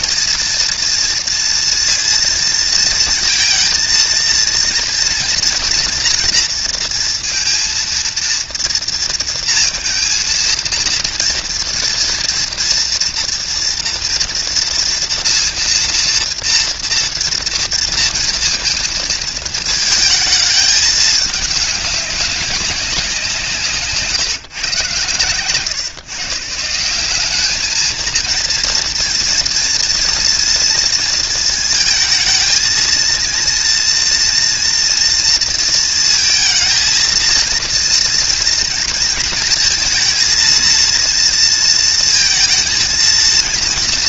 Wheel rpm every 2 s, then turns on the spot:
240, 230, 230, 230, 230, 230, 230, 230, 230, 230, 220, 190, 130, 160, 230, 230, 220, 230, 220, 230, 230, 230.
none